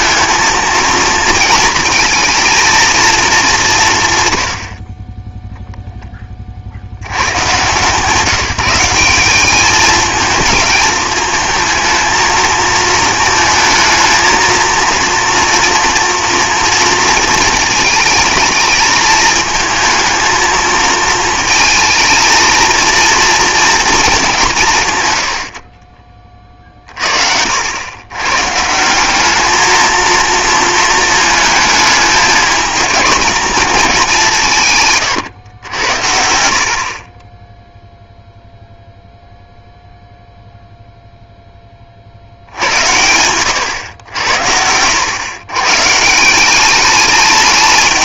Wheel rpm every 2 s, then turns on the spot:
230, 230, 60, 70, 180, 220, 220, 230, 230, 220, 220, 230, 150, 40, 160, 230, 220, 150, 60, 0, 0, 80, 90, 200.
none